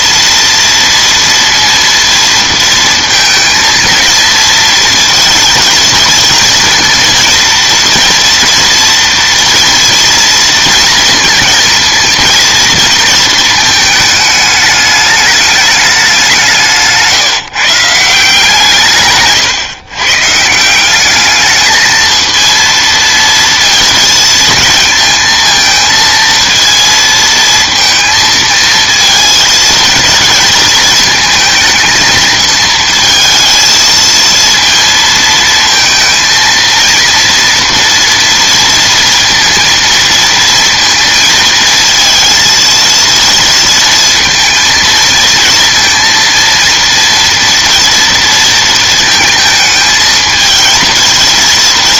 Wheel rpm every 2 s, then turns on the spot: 230, 230, 230, 230, 230, 230, 230, 210, 160, 140, 190, 230, 230, 230, 220, 230, 220, 230, 230, 230, 230, 230, 220, 230, 220, 220.
16-18